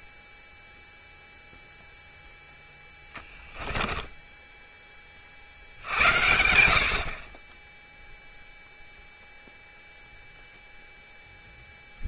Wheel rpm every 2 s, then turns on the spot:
0, 10, 20, 70, 0, 0.
none